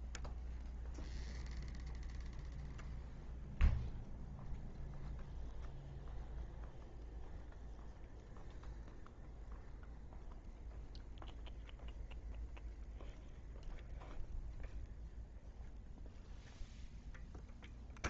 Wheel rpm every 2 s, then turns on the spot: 0, 0, 0, 0, 0, 0, 0, 0, 0.
none